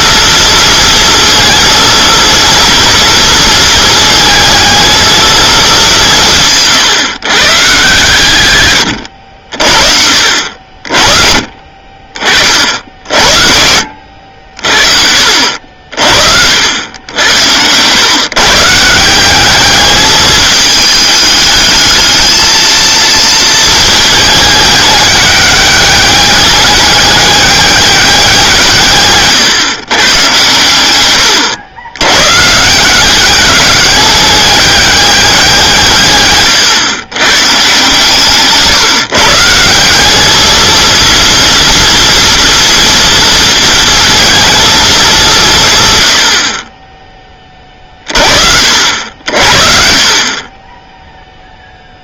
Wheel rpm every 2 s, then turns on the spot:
230, 240, 220, 140, 100, 50, 60, 60, 80, 150, 210, 220, 210, 200, 160, 110, 170, 200, 120, 150, 220, 230, 220, 30, 60, 50.
none